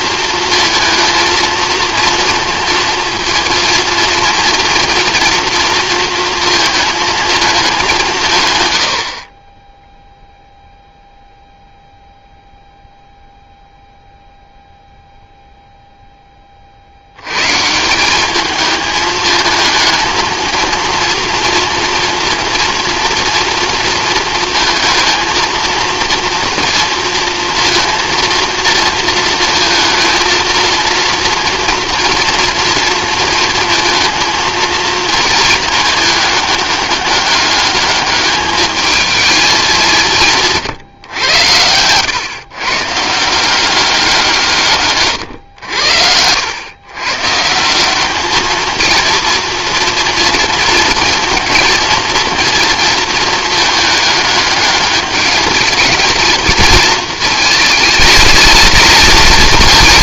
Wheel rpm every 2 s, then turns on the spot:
230, 230, 230, 220, 50, 0, 0, 0, 80, 220, 230, 240, 230, 240, 230, 230, 230, 220, 200, 220, 120, 150, 130, 120, 230, 230, 230, 210, 220, 220.
44-46